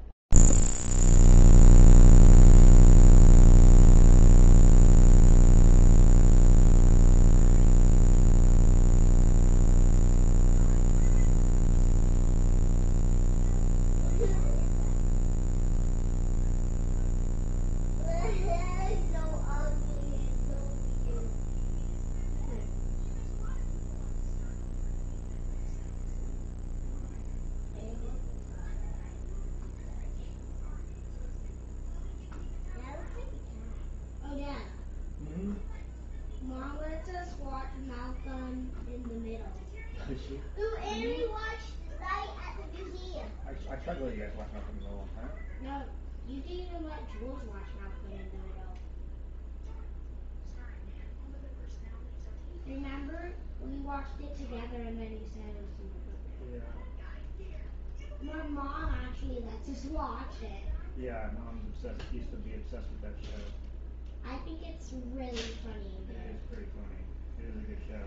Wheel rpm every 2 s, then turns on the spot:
0, 0, 0, 0, 0, 0, 0, 0, 0, 0, 0, 0, 0, 0, 0, 0, 0, 0, 0, 0, 0, 0, 0, 0, 0, 0, 0, 0, 0, 0, 0, 0, 0, 0.
none